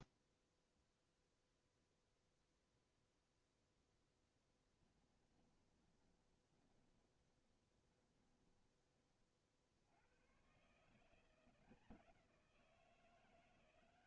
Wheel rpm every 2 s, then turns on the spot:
0, 0, 10, 20, 10, 130, 180.
4-10